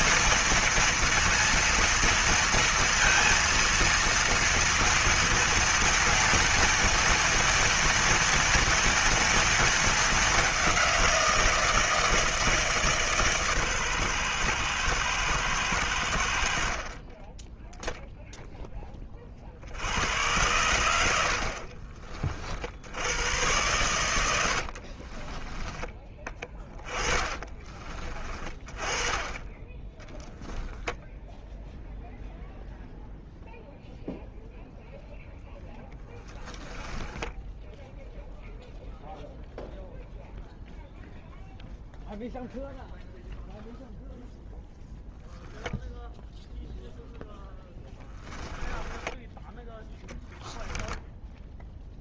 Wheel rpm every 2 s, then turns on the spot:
230, 230, 230, 230, 230, 190, 160, 120, 50, 10, 90, 60, 70, 20, 30, 10, 0, 0, 10, 0, 0, 0, 0, 0, 10, 10.
24-28 36-38 48-52